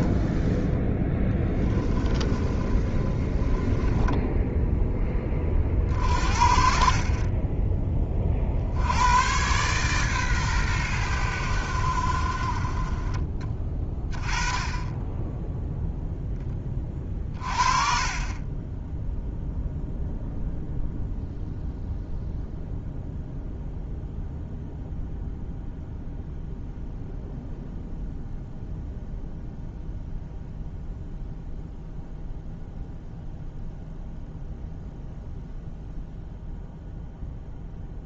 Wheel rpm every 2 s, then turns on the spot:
10, 30, 10, 50, 80, 110, 30, 20, 20, 20, 0, 0, 0, 0, 0, 0, 0, 0, 0.
0-4